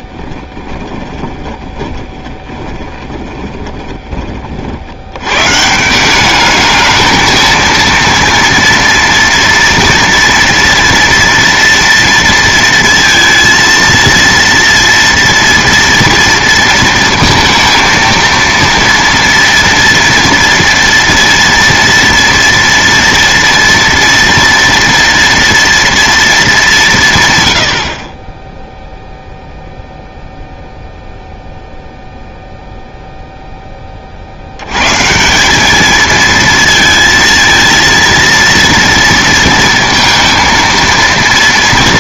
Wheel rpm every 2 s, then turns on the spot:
20, 20, 50, 210, 230, 230, 230, 230, 230, 230, 240, 230, 230, 210, 10, 0, 0, 100, 230, 230, 230.
0-4